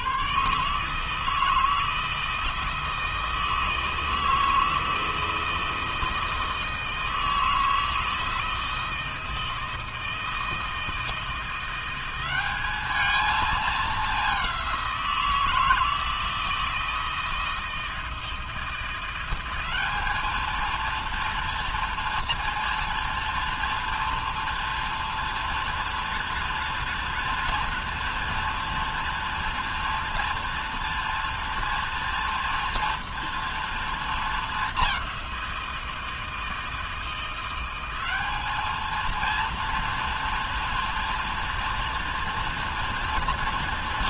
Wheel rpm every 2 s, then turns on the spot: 150, 160, 160, 160, 160, 160, 210, 180, 160, 170, 230, 230, 230, 230, 230, 230, 230, 200, 160, 220, 230, 230.
none